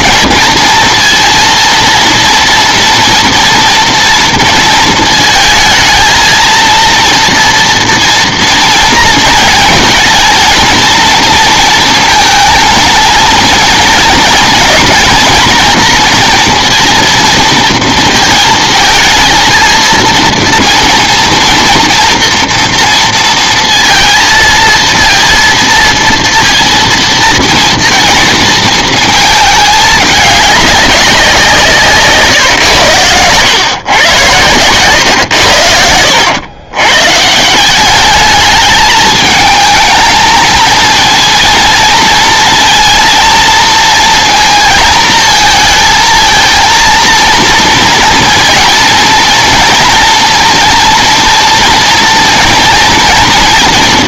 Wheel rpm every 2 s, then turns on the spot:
230, 230, 230, 230, 230, 230, 230, 230, 230, 230, 230, 240, 230, 230, 220, 200, 130, 110, 110, 210, 230, 230, 230, 230, 230, 230, 230.
none